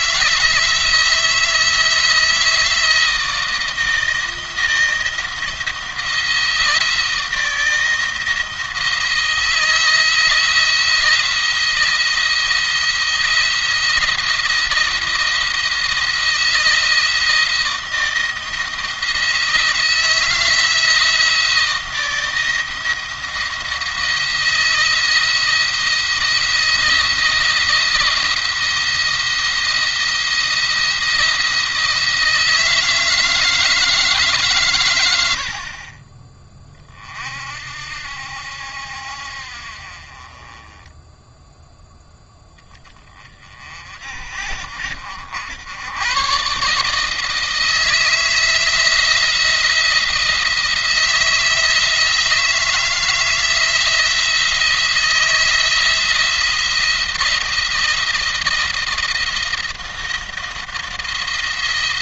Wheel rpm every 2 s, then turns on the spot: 170, 170, 170, 160, 170, 170, 170, 170, 160, 170, 170, 170, 170, 170, 170, 170, 160, 130, 30, 70, 20, 10, 60, 140, 160, 170, 170, 170, 170, 160, 170.
none